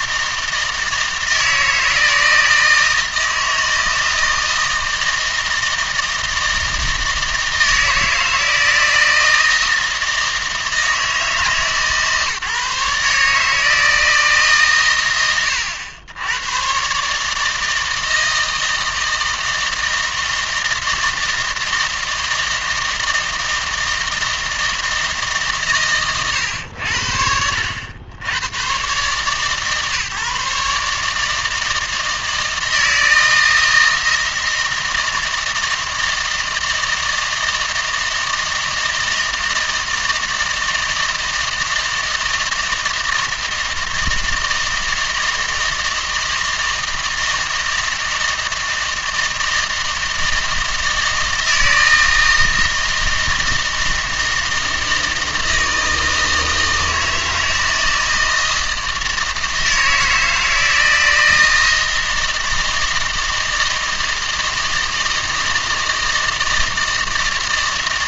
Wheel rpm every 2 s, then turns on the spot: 160, 160, 160, 160, 160, 160, 150, 140, 130, 160, 160, 160, 160, 100, 110, 150, 160, 160, 160, 160, 160, 160, 160, 160, 160, 160, 160, 160, 160, 160, 160, 160, 160, 160.
none